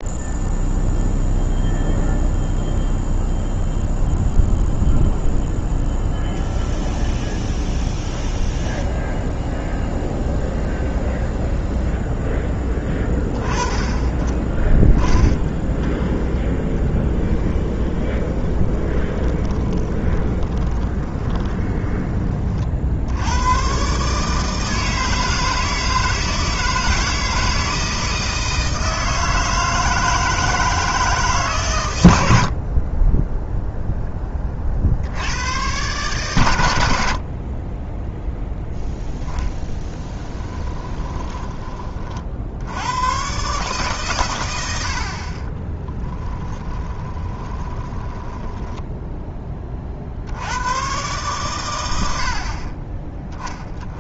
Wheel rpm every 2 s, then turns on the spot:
0, 0, 0, 0, 0, 0, 10, 10, 10, 20, 20, 50, 160, 160, 160, 160, 40, 40, 100, 0, 10, 80, 90, 10, 10, 110, 30.
16-22 40-42 46-50